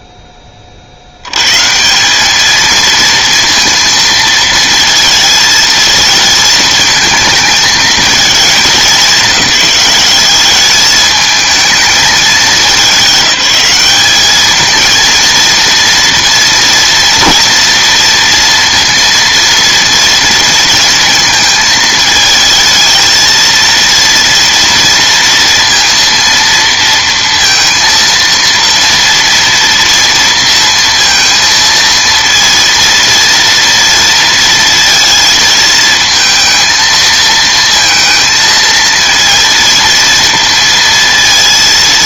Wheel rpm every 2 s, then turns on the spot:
40, 220, 230, 220, 220, 210, 210, 210, 230, 230, 220, 220, 230, 230, 230, 230, 230, 230, 230, 230, 230.
none